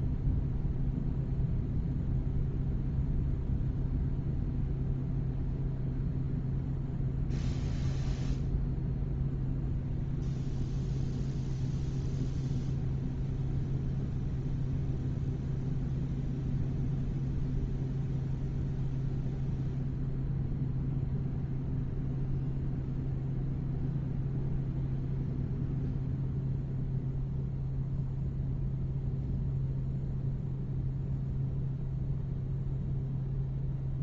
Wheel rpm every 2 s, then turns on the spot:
0, 0, 0, 0, 0, 0, 0, 0, 0, 0, 0, 0, 0, 0, 0, 0, 0.
none